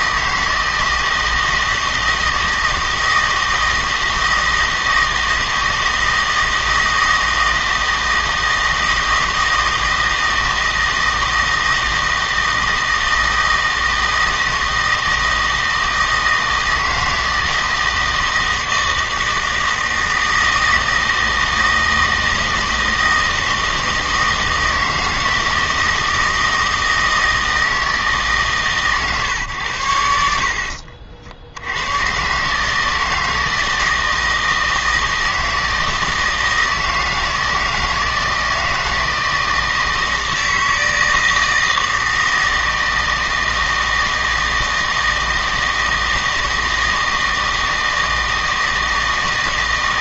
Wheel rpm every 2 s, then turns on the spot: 160, 160, 160, 160, 160, 160, 160, 160, 160, 160, 160, 160, 160, 160, 140, 50, 150, 160, 160, 160, 160, 160, 160, 160, 160.
none